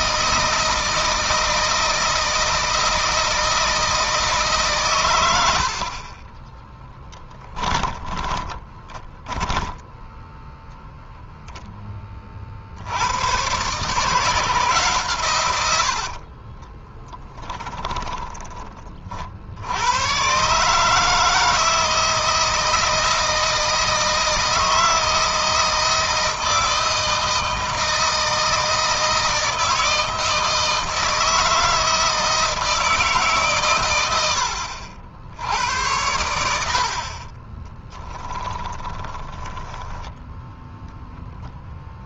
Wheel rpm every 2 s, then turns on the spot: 160, 160, 120, 10, 20, 0, 80, 140, 20, 30, 150, 160, 160, 160, 160, 160, 160, 70, 70, 10, 0.
6-10 16-18 38-40